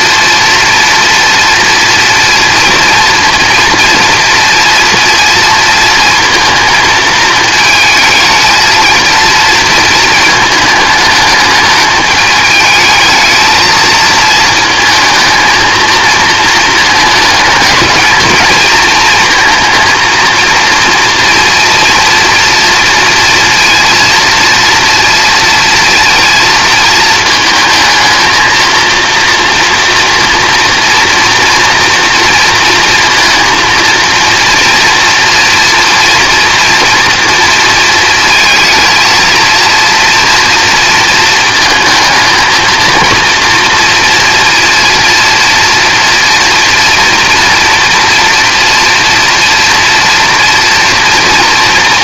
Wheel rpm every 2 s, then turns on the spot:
230, 240, 240, 220, 230, 220, 220, 220, 220, 220, 230, 230, 230, 230, 230, 230, 230, 230, 240, 220, 230, 230, 240, 230, 240, 230.
none